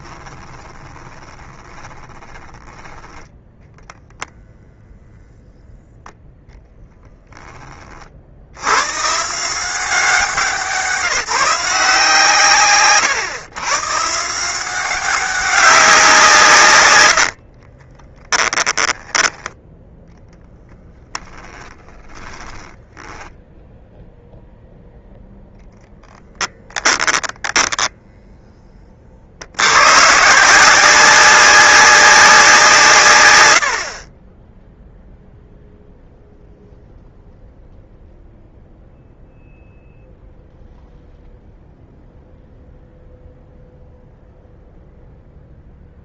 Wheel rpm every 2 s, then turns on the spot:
20, 10, 0, 10, 110, 180, 140, 180, 110, 10, 10, 10, 0, 10, 30, 180, 150, 0, 0, 0, 0, 0, 0.
0-2 6-8 16-20 22-24 26-28